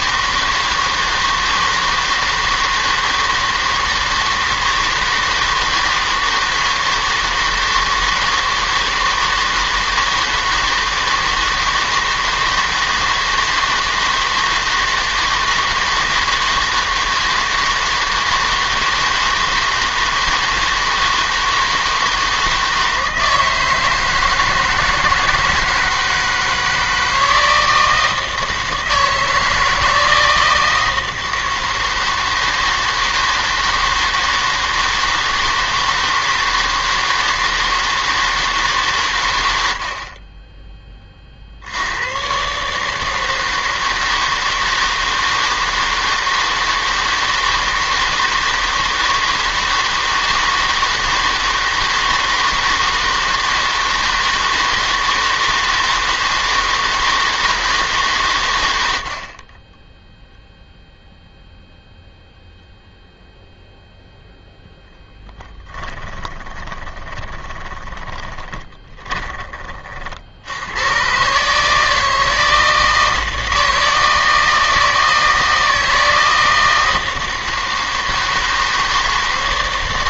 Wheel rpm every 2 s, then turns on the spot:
160, 160, 160, 160, 160, 160, 160, 160, 160, 160, 160, 160, 160, 160, 160, 160, 160, 160, 160, 150, 30, 150, 160, 160, 160, 160, 160, 160, 160, 90, 0, 0, 0, 20, 20, 90, 160, 160, 160, 160.
66-70